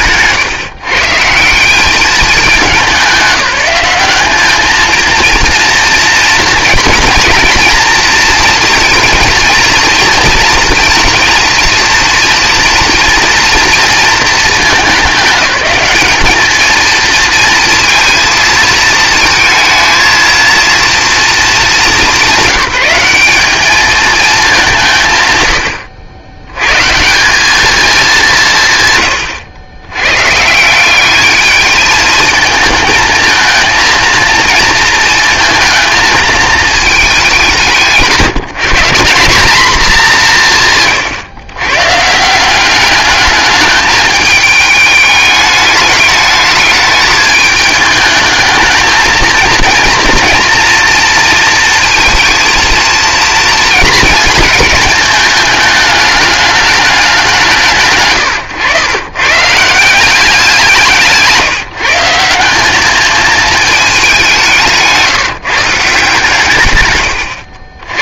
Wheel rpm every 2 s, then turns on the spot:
140, 180, 220, 230, 230, 230, 230, 200, 220, 220, 230, 190, 160, 130, 150, 190, 230, 230, 210, 170, 140, 200, 210, 210, 220, 230, 230, 220, 200, 100, 180, 220, 170, 130.
none